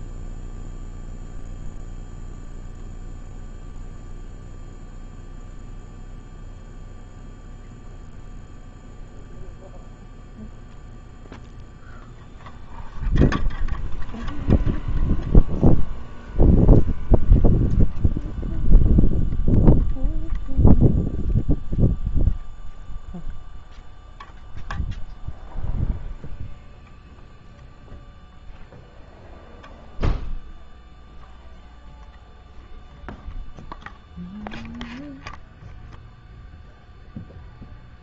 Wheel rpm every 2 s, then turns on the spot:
0, 0, 0, 0, 0, 0, 0, 0, 0, 0, 0, 0, 0, 0, 0, 0, 0, 0, 0.
none